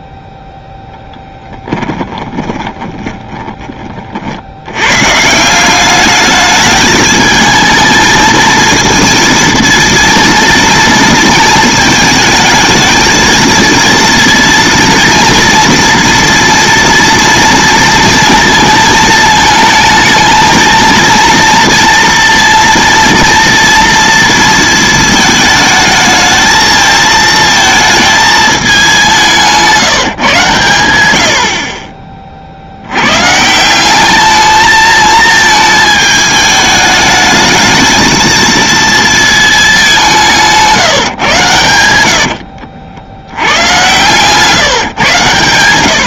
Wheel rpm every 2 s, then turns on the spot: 0, 30, 110, 210, 230, 230, 220, 230, 230, 230, 230, 230, 230, 220, 210, 120, 70, 220, 210, 230, 150, 70, 140.
2-4